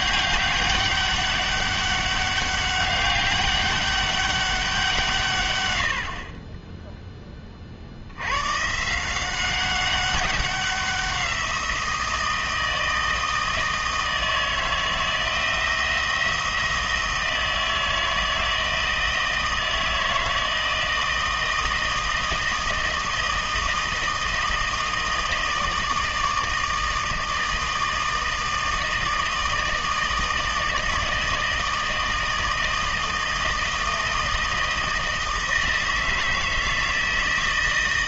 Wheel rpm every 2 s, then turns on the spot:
200, 200, 190, 10, 130, 190, 160, 160, 160, 160, 160, 160, 160, 160, 160, 160, 160, 160, 160.
none